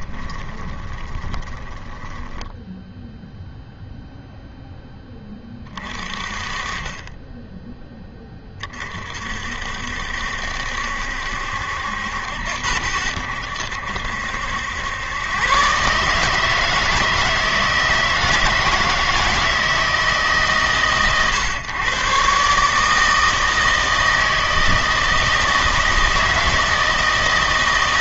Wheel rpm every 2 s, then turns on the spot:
20, 10, 10, 30, 30, 70, 80, 90, 160, 160, 140, 140, 160, 160.
0-4